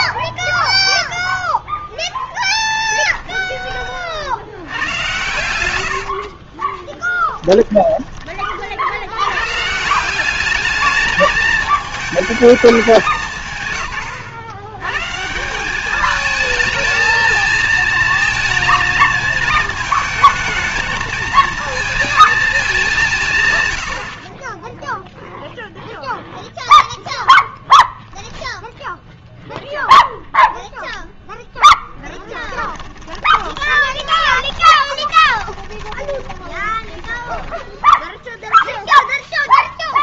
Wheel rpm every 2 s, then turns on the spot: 0, 20, 90, 20, 60, 210, 200, 130, 220, 220, 220, 200, 10, 0, 0, 0, 10, 20, 10, 0.
2-4 6-8 32-38